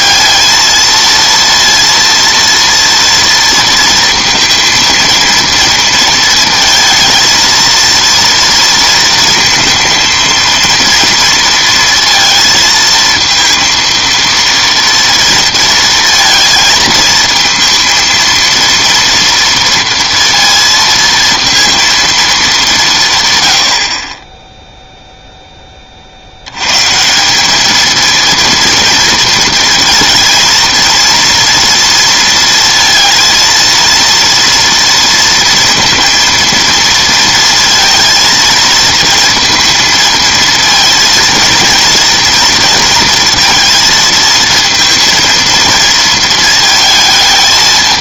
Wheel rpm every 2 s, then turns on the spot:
230, 230, 230, 230, 230, 230, 230, 230, 230, 230, 230, 200, 10, 110, 230, 230, 230, 230, 230, 220, 230, 230, 230, 220.
none